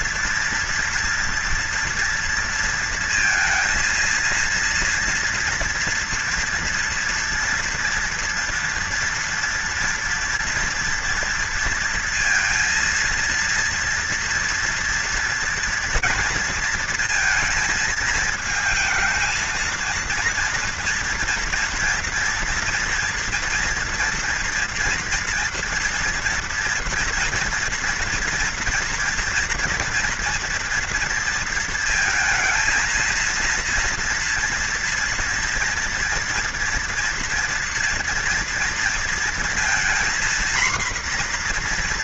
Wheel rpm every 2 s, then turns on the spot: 230, 230, 230, 240, 240, 240, 230, 230, 230, 220, 230, 230, 230, 230, 230, 230, 220, 230, 230, 230, 240.
none